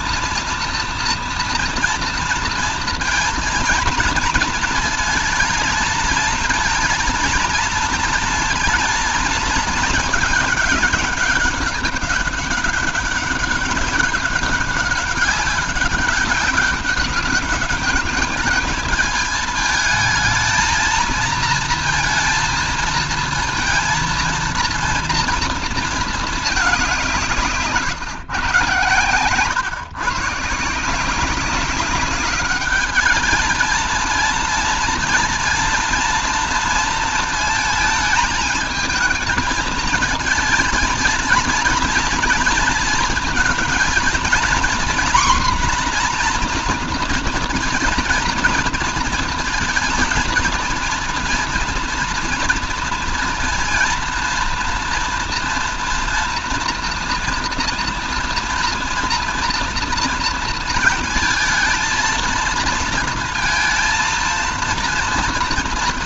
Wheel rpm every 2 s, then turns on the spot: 230, 230, 220, 230, 220, 210, 200, 190, 190, 210, 230, 230, 230, 210, 120, 140, 210, 230, 230, 220, 220, 230, 240, 240, 230, 230, 230, 230, 240, 230, 230, 230, 230.
none